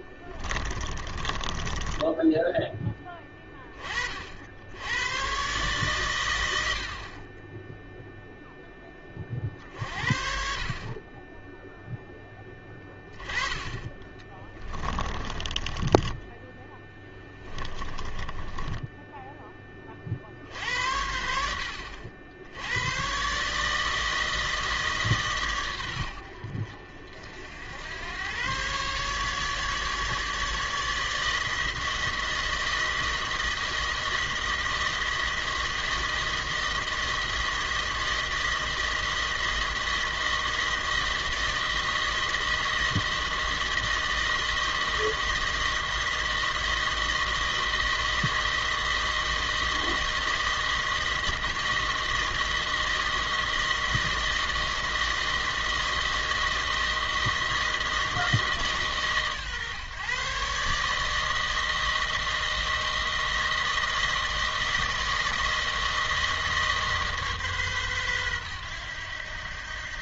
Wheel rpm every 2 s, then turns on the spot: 20, 10, 70, 90, 0, 50, 10, 20, 10, 20, 60, 80, 160, 70, 120, 150, 160, 160, 160, 160, 160, 160, 160, 160, 160, 160, 160, 160, 160, 150, 140, 160, 160, 160, 110.
0-2 14-16 18-20